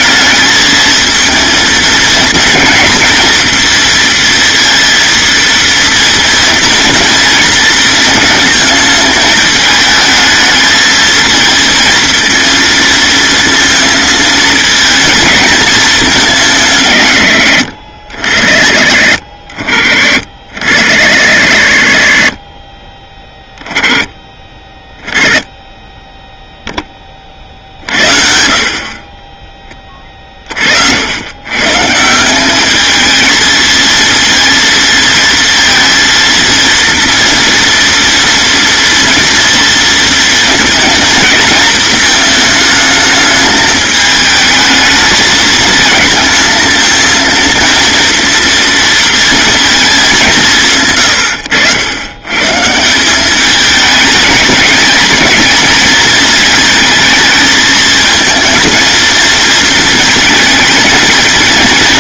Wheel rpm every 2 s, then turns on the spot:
220, 230, 230, 230, 220, 230, 230, 220, 150, 50, 60, 20, 10, 20, 30, 70, 210, 230, 230, 230, 230, 220, 220, 230, 230, 130, 170, 210, 220, 230, 220.
none